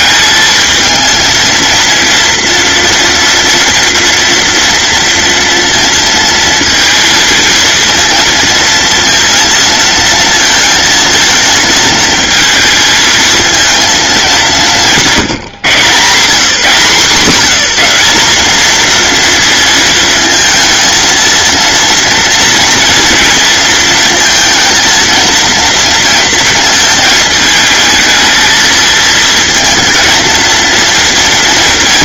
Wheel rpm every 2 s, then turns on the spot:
220, 230, 240, 230, 230, 230, 220, 180, 160, 230, 230, 230, 230, 230, 220, 230.
none